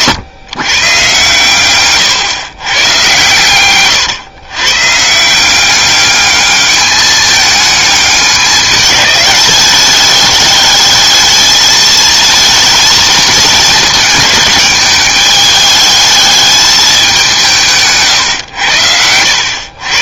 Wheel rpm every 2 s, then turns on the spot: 130, 120, 130, 210, 200, 220, 220, 210, 210, 100.
18-20